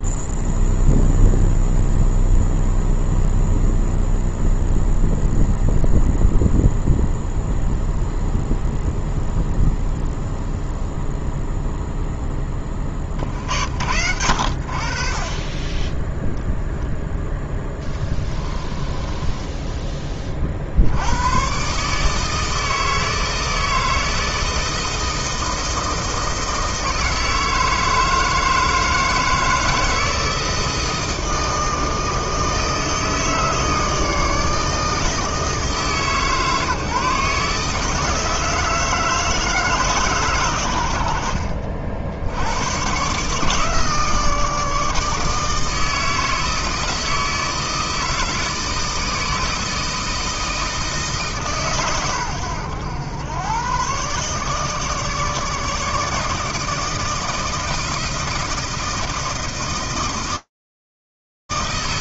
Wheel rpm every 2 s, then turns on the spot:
0, 0, 0, 0, 0, 0, 40, 60, 10, 20, 70, 160, 160, 160, 160, 160, 160, 160, 150, 160, 90, 120, 160, 160, 160, 160, 100, 150, 160, 160, 160.
18-20